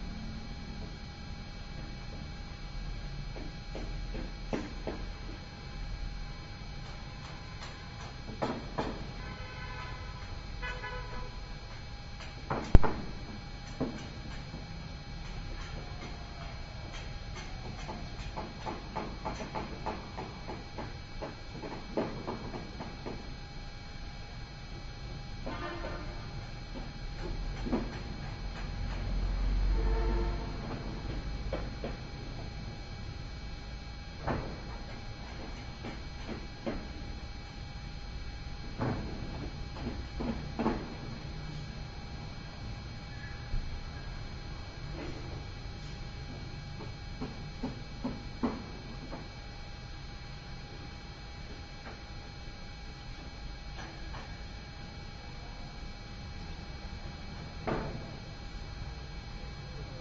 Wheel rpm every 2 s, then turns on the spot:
0, 0, 0, 0, 0, 0, 0, 0, 0, 0, 0, 0, 0, 0, 0, 0, 0, 0, 0, 0, 0, 0, 0, 0, 0, 0, 0, 0, 0, 0.
none